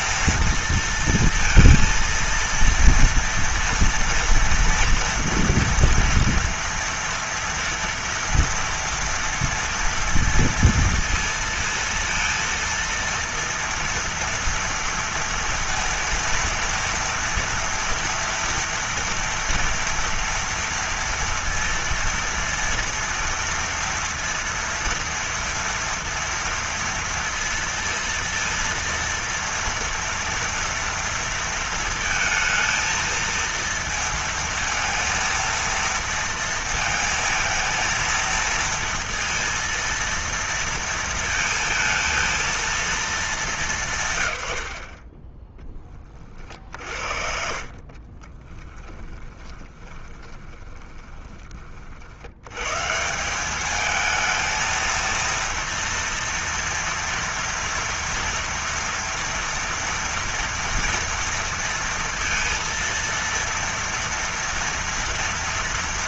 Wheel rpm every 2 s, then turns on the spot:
230, 230, 230, 230, 230, 230, 230, 230, 230, 240, 230, 230, 230, 230, 230, 230, 230, 230, 230, 230, 230, 230, 110, 40, 20, 20, 90, 220, 230, 230, 230, 230, 230.
48-52